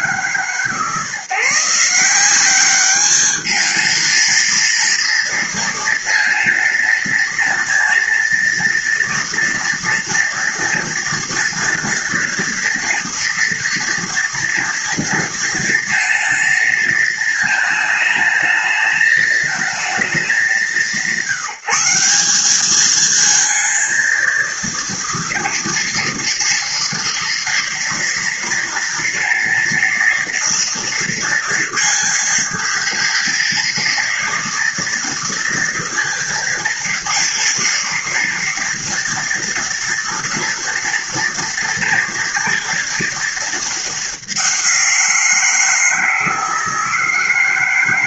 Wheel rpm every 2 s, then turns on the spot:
150, 210, 230, 230, 230, 230, 230, 230, 220, 220, 170, 220, 230, 240, 230, 230, 230, 230, 230, 230, 230, 230, 170, 160.
none